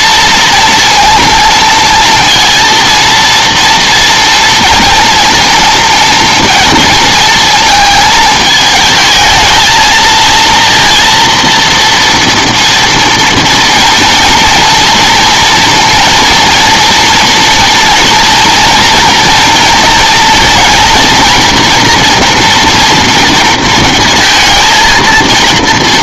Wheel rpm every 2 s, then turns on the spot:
230, 230, 230, 230, 220, 230, 230, 230, 240, 230, 230, 230, 220.
none